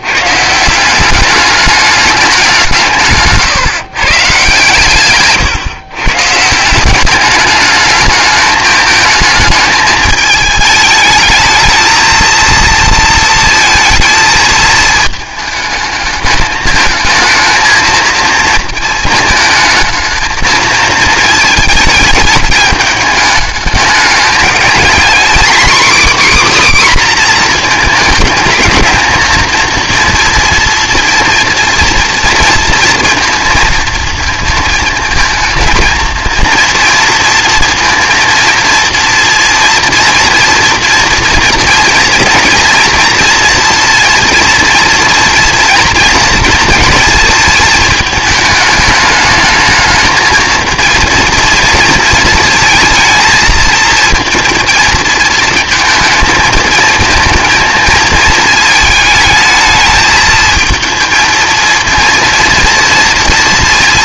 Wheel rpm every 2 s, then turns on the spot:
170, 180, 140, 170, 220, 210, 230, 220, 220, 230, 230, 220, 220, 280, 220, 230, 230, 220, 230, 230, 230, 230, 230, 240, 210, 220, 220, 230, 220, 220, 220, 230.
none